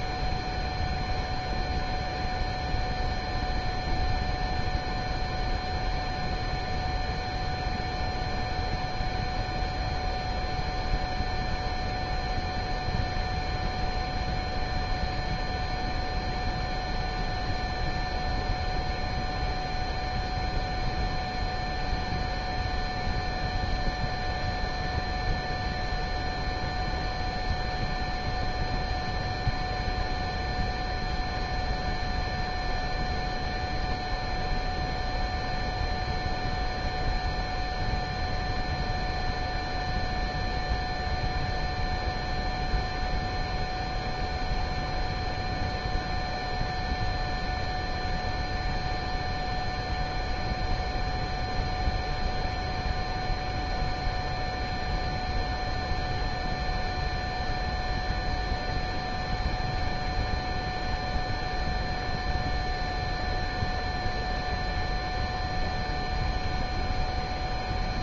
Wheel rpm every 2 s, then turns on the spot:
0, 0, 0, 0, 0, 0, 0, 0, 0, 0, 0, 0, 0, 0, 0, 0, 0, 0, 0, 0, 0, 0, 0, 0, 0, 0, 0, 0, 0, 0, 0, 0, 0, 0.
none